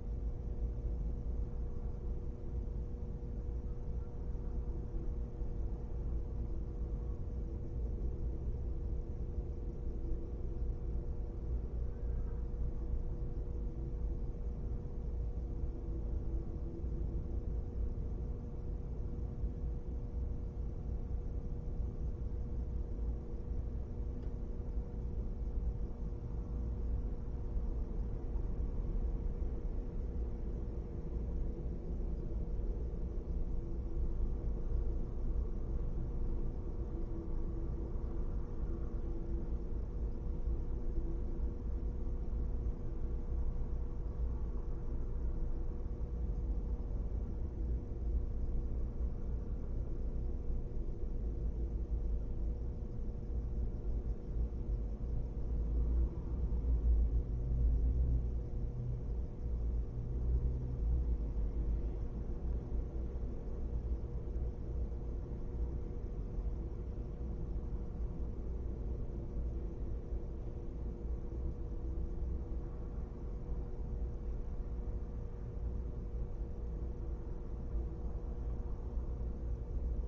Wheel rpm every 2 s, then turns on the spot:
0, 0, 0, 0, 0, 0, 0, 0, 0, 0, 0, 0, 0, 0, 0, 0, 0, 0, 0, 0, 0, 0, 0, 0, 0, 0, 0, 0, 0, 0, 0, 0, 0, 0, 0, 0, 0, 0, 0, 0.
none